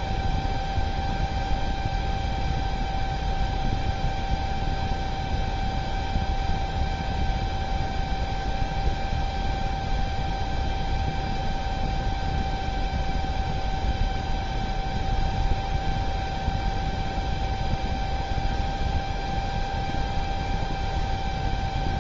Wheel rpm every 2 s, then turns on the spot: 0, 0, 0, 0, 0, 0, 0, 0, 0, 0, 0.
none